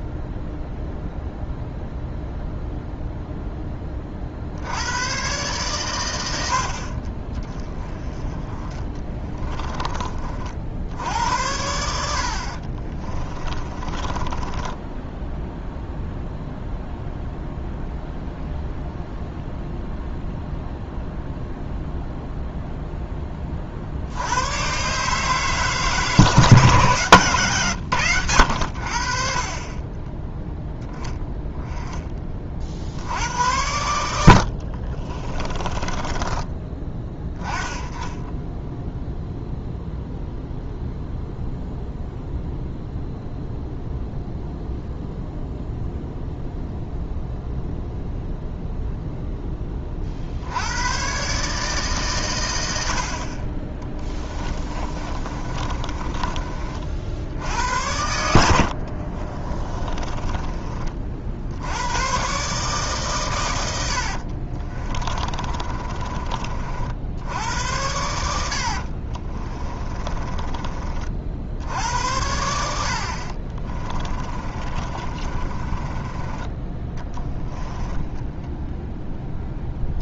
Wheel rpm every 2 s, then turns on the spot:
0, 0, 90, 40, 20, 60, 30, 10, 0, 0, 0, 0, 130, 150, 60, 0, 60, 40, 10, 0, 0, 0, 0, 0, 0, 110, 70, 30, 50, 70, 40, 140, 30, 50, 60, 30, 70, 30, 10, 0.
8-10 12-16 34-36 54-56 58-60 64-66 68-70 74-76